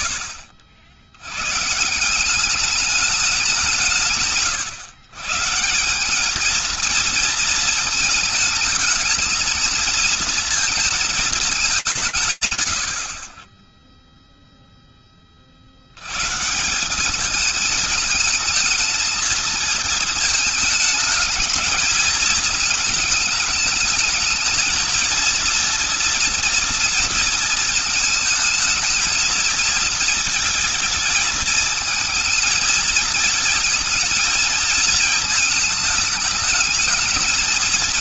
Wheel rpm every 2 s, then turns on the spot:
70, 200, 130, 220, 220, 230, 150, 0, 160, 220, 220, 220, 230, 230, 220, 220, 220, 220, 220.
none